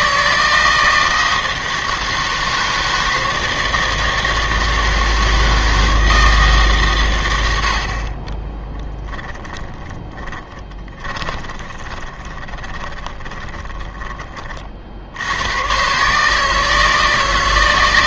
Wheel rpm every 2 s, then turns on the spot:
160, 160, 160, 140, 20, 20, 20, 40, 150.
8-14